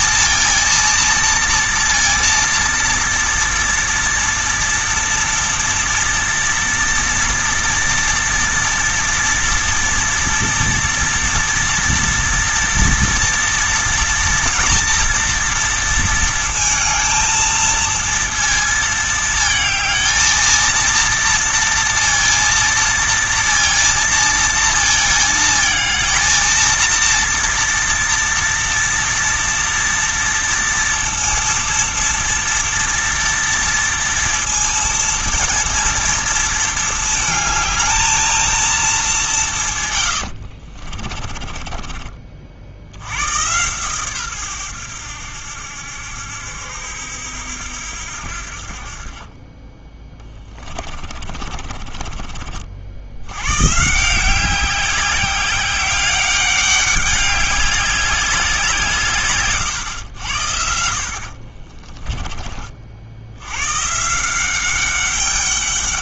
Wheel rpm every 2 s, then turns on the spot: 230, 230, 230, 230, 230, 230, 230, 230, 230, 220, 230, 230, 230, 230, 230, 230, 230, 230, 220, 220, 60, 60, 100, 80, 50, 20, 50, 190, 200, 170, 80, 50, 190.
40-42 50-52